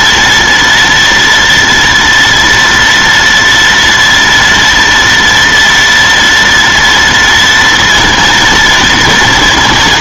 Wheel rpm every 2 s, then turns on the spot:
230, 230, 230, 230, 230.
none